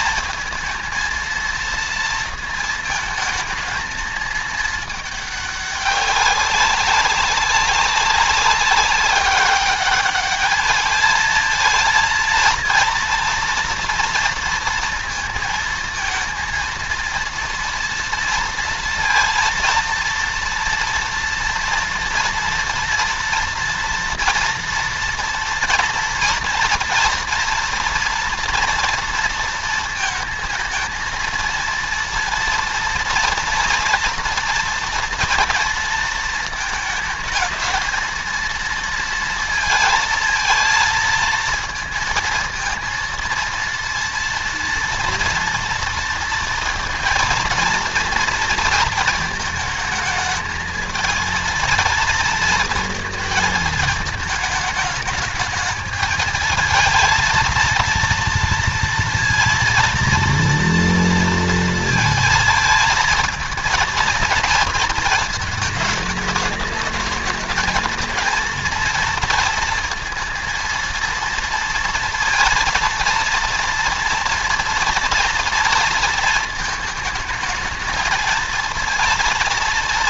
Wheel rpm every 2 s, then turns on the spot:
220, 230, 220, 190, 190, 210, 230, 230, 230, 230, 230, 230, 230, 230, 230, 220, 240, 230, 220, 230, 230, 230, 230, 230, 230, 220, 230, 210, 220, 230, 230, 230, 230, 220, 230, 230, 230, 230, 220, 230.
none